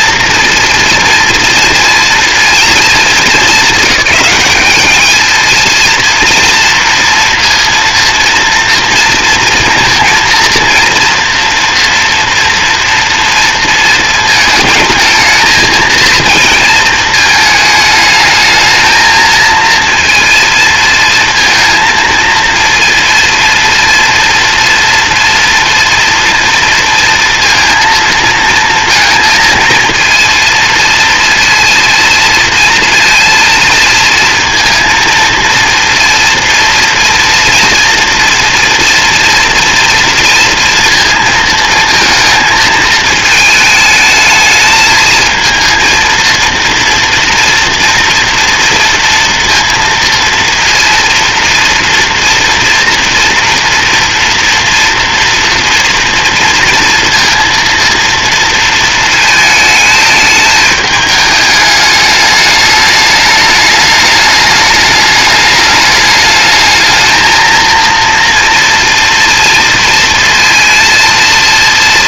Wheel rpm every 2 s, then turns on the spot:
230, 210, 220, 230, 230, 230, 230, 230, 220, 220, 230, 230, 230, 230, 230, 230, 230, 230, 230, 230, 220, 220, 220, 230, 230, 230, 230, 230, 230, 220, 210, 210, 210, 230, 240, 230.
none